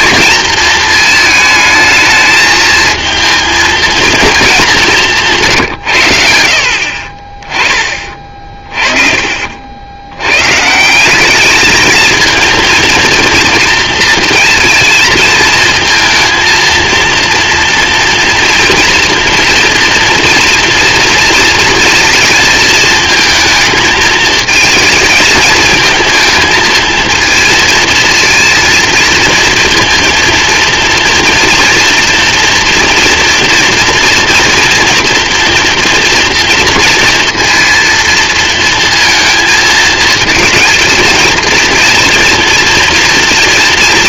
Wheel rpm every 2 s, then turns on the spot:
220, 220, 160, 30, 30, 170, 230, 230, 230, 230, 230, 220, 220, 230, 230, 230, 230, 240, 230, 230, 220, 230.
none